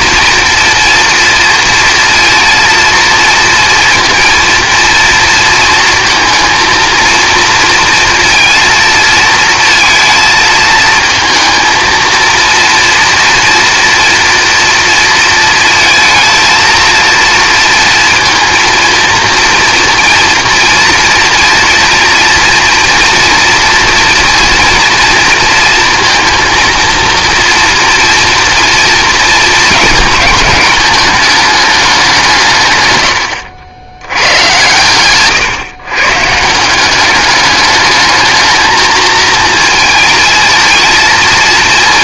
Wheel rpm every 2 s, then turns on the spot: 240, 230, 230, 230, 230, 220, 230, 230, 230, 230, 230, 230, 230, 230, 240, 210, 130, 120, 180, 220, 230.
none